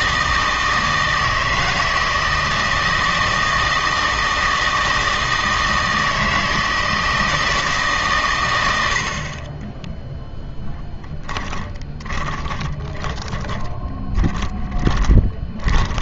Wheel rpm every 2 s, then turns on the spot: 160, 160, 160, 160, 100, 10, 20, 30.
10-16